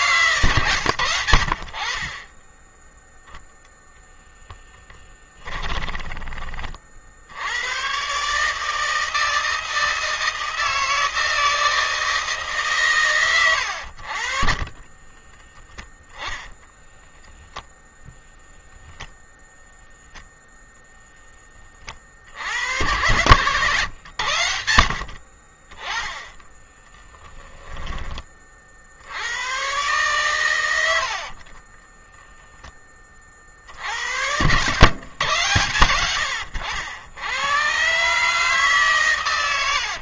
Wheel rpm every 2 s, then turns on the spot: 100, 0, 10, 60, 160, 160, 120, 20, 0, 10, 10, 110, 60, 10, 90, 60, 30, 130, 90, 120.
4-6 14-16 22-24 26-28